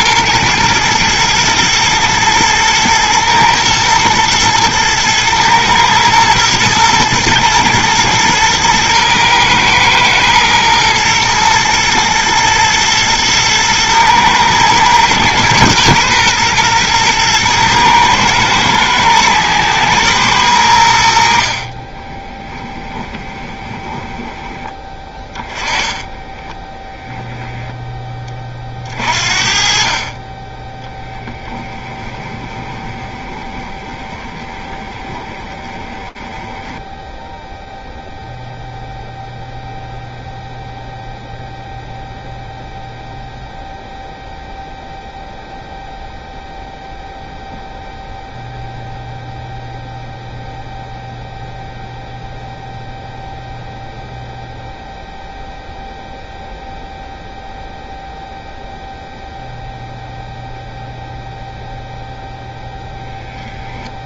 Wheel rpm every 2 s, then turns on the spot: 110, 110, 110, 120, 110, 110, 120, 110, 120, 110, 90, 20, 20, 0, 40, 10, 20, 20, 10, 0, 0, 0, 0, 0, 0, 0, 0, 0, 0, 0, 0, 10.
22-24 32-38